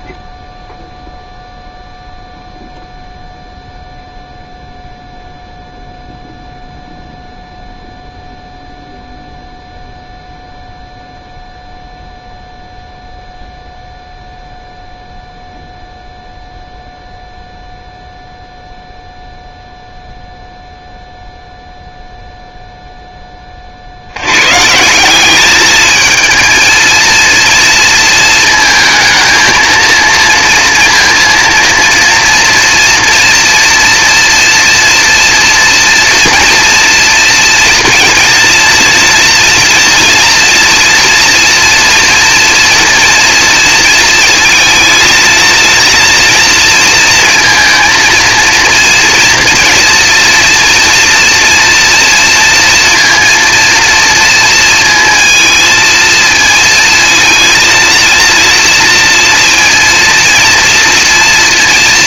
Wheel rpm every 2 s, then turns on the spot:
0, 0, 0, 0, 0, 0, 0, 0, 0, 0, 0, 0, 140, 220, 220, 230, 230, 230, 230, 230, 230, 230, 230, 230, 230, 240, 230, 230, 230, 230, 230.
none